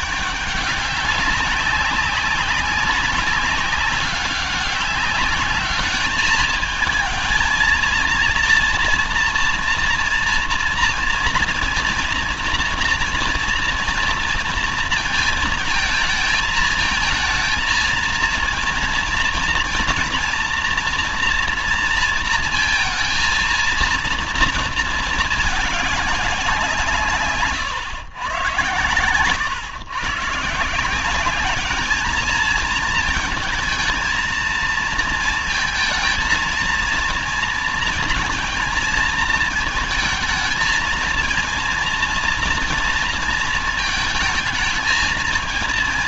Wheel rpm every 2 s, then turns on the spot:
210, 190, 200, 220, 230, 230, 230, 230, 220, 230, 230, 230, 230, 180, 120, 150, 220, 230, 220, 230, 220, 230, 220.
none